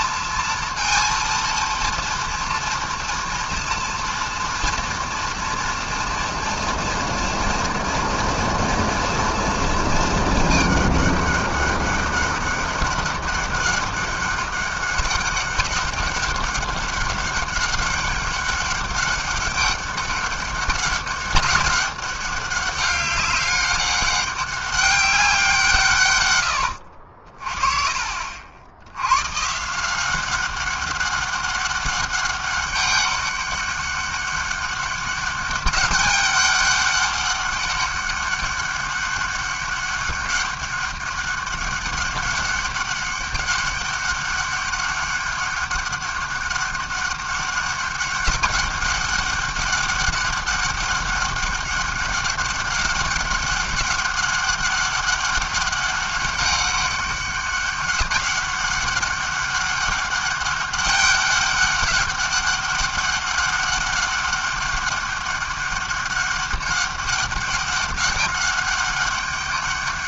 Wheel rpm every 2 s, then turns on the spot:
230, 240, 230, 230, 230, 220, 200, 200, 200, 200, 200, 200, 200, 100, 60, 190, 200, 200, 200, 200, 200, 200, 200, 200, 200, 200, 200, 200, 200, 200, 200, 200, 200, 200, 200.
none